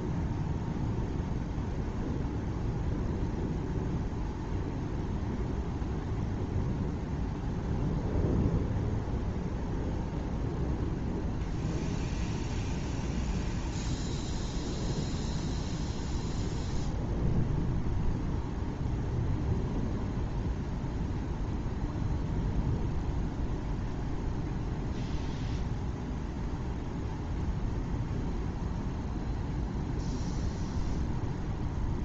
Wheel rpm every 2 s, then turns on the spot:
0, 0, 0, 0, 0, 0, 0, 0, 0, 0, 0, 0, 0, 0, 0, 0.
none